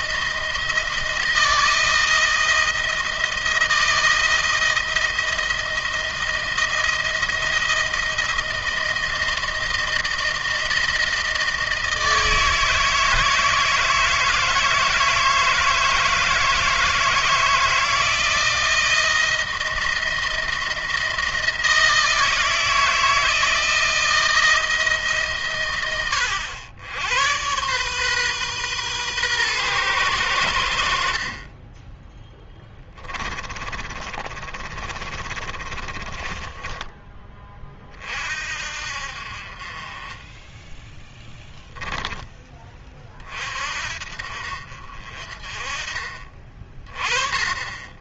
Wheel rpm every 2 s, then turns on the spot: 160, 160, 160, 170, 160, 160, 160, 160, 160, 170, 170, 160, 150, 100, 120, 60, 20, 30, 20, 50, 0, 20, 40, 20.
32-36